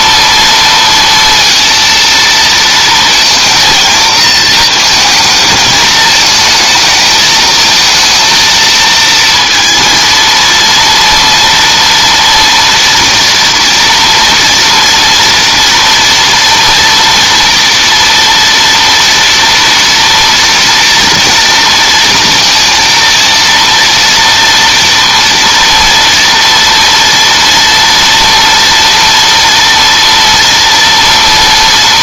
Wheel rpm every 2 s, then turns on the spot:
230, 220, 230, 220, 230, 230, 230, 230, 230, 230, 230, 230, 230, 230, 240, 230.
none